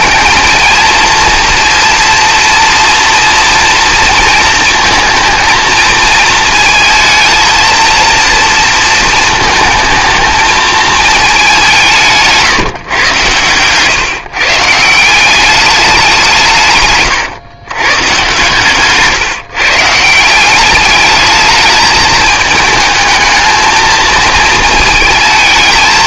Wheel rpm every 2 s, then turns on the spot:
230, 240, 230, 220, 230, 220, 150, 150, 140, 140, 200, 220, 220.
none